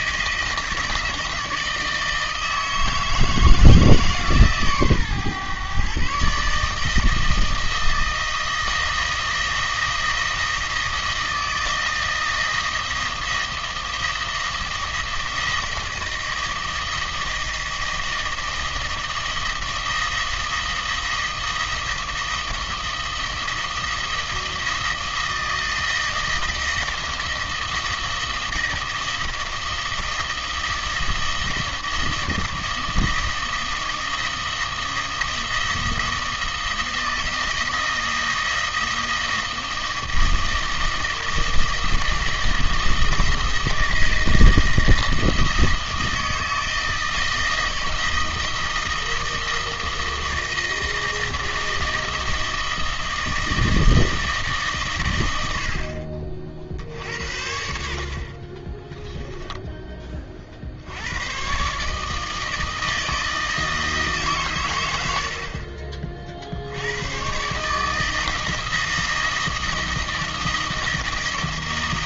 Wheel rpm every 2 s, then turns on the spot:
160, 160, 140, 150, 160, 160, 160, 160, 160, 160, 160, 160, 160, 160, 160, 160, 160, 160, 160, 160, 160, 160, 160, 160, 160, 160, 160, 130, 50, 30, 50, 160, 120, 70, 160, 160.
58-60